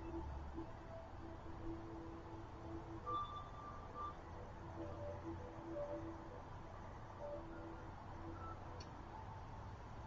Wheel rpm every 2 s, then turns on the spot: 0, 0, 0, 0, 0.
none